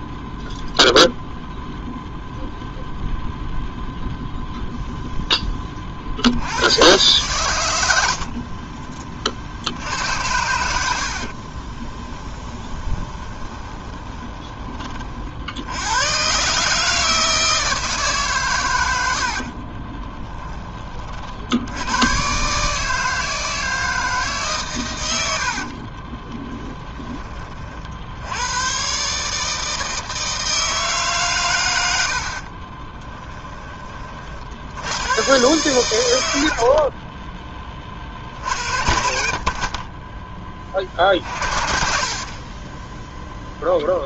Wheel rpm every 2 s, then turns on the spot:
0, 0, 0, 110, 40, 70, 20, 30, 150, 100, 30, 160, 110, 20, 130, 160, 20, 90, 50, 60, 30, 10.
8-10 12-14 32-34